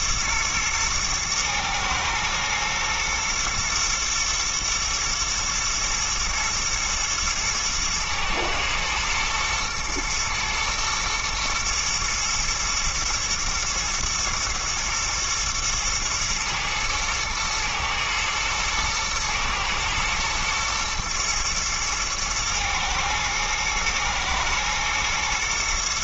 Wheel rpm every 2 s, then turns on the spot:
110, 110, 120, 120, 110, 120, 120, 120, 110, 110, 120, 110, 120.
none